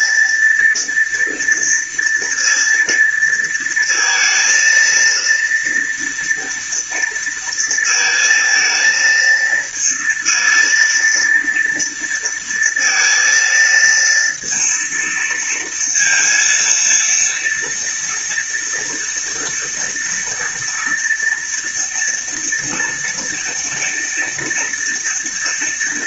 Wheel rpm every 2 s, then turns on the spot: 230, 230, 230, 230, 230, 230, 230, 230, 230, 230, 230, 230, 230.
none